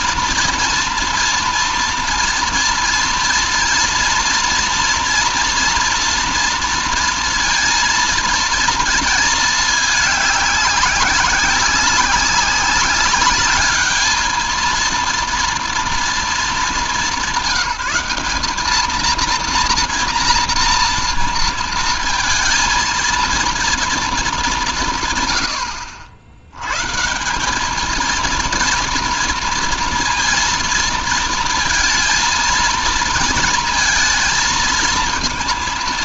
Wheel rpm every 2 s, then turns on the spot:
230, 230, 230, 230, 220, 200, 200, 230, 180, 230, 230, 230, 150, 160, 230, 230, 230, 230.
none